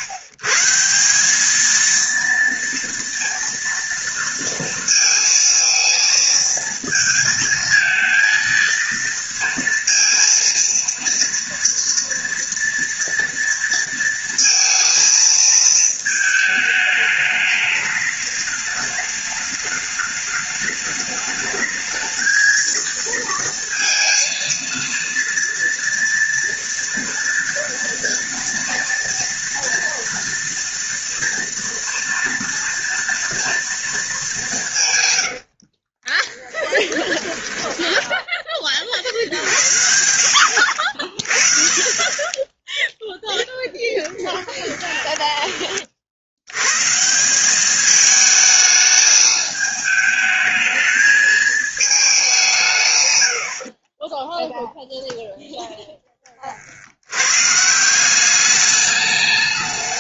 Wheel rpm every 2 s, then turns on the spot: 140, 230, 230, 230, 230, 230, 230, 230, 220, 210, 210, 220, 230, 230, 230, 230, 230, 180, 10, 20, 70, 10, 10, 90, 220, 220, 170, 0, 30, 200.
36-38 44-46